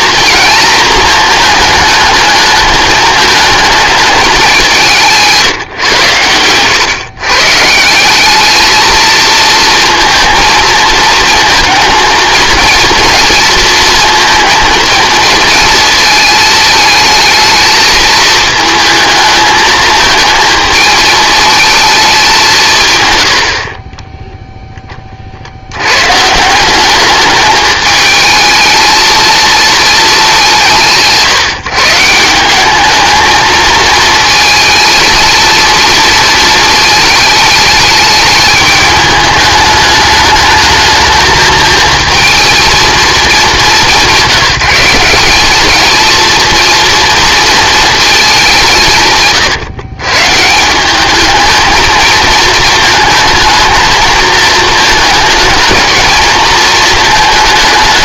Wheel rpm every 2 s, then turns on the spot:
230, 220, 190, 120, 220, 220, 230, 230, 220, 220, 220, 140, 10, 190, 220, 150, 200, 220, 220, 210, 210, 220, 170, 230, 160, 180, 230, 220, 220.
none